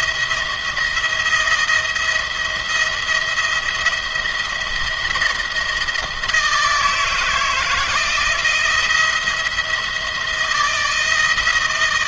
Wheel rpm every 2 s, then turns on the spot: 170, 170, 170, 160, 170, 160.
none